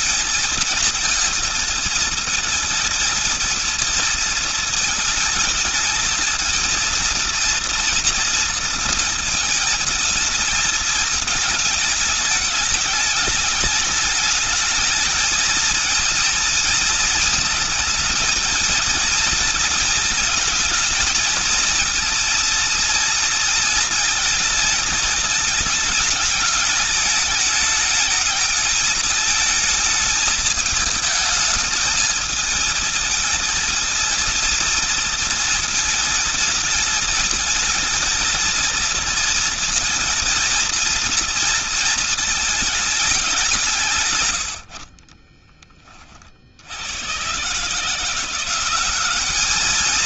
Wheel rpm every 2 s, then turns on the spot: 230, 220, 220, 230, 230, 210, 210, 230, 220, 220, 230, 220, 210, 220, 220, 220, 230, 220, 220, 230, 230, 160, 30, 140, 220.
42-44